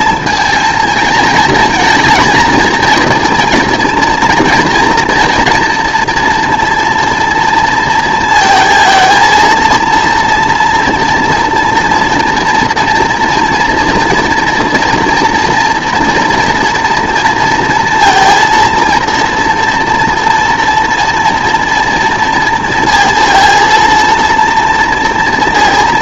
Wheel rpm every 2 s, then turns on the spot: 230, 230, 230, 240, 230, 230, 230, 230, 240, 230, 230, 230, 230.
none